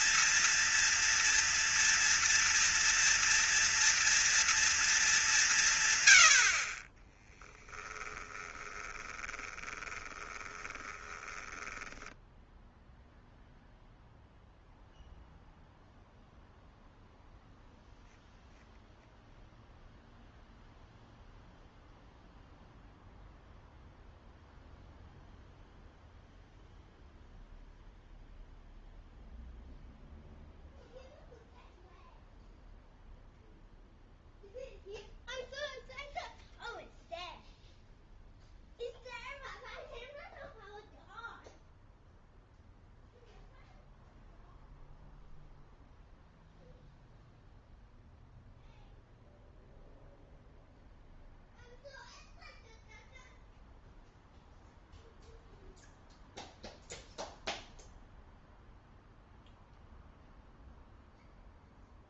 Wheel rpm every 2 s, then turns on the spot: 230, 230, 220, 20, 20, 20, 0, 0, 0, 0, 0, 0, 0, 0, 0, 0, 0, 0, 0, 0, 0, 0, 0, 0, 0, 0, 0, 0, 0, 0, 0.
8-12